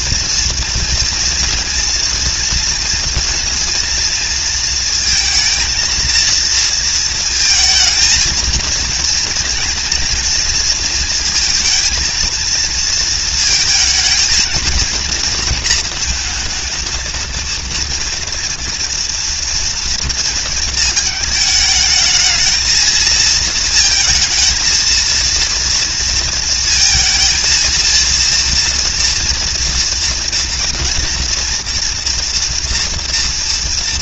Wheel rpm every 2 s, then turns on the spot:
240, 230, 220, 220, 220, 230, 230, 230, 230, 230, 220, 220, 230, 230, 230, 240, 230.
none